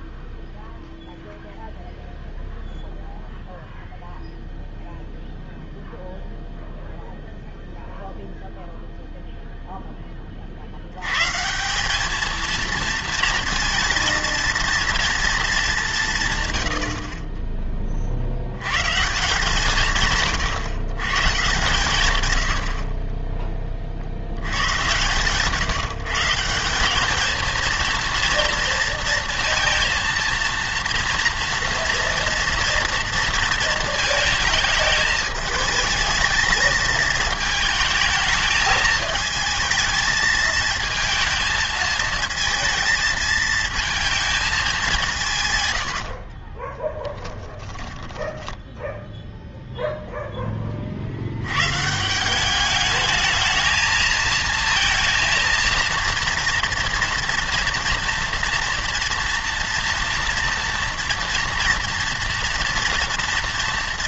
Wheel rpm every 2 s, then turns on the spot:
0, 0, 0, 0, 0, 60, 230, 230, 100, 120, 130, 70, 100, 180, 230, 230, 230, 220, 220, 220, 220, 230, 200, 20, 10, 20, 200, 220, 230, 230, 230, 230.
46-50